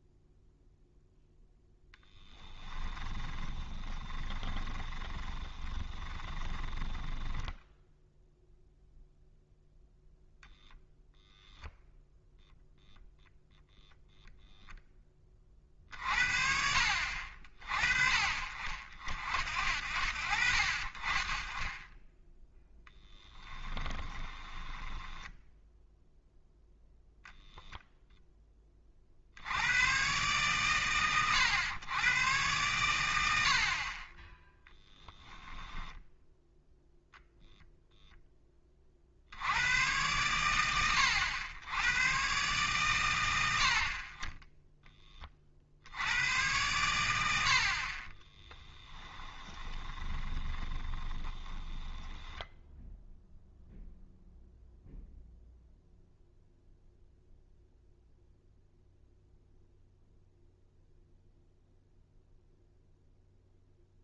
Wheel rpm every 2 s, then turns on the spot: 0, 20, 20, 20, 0, 0, 0, 0, 60, 40, 40, 10, 10, 0, 20, 120, 110, 10, 0, 30, 100, 130, 10, 100, 10, 20, 0, 0, 0, 0, 0, 0.
2-8 24-26 48-52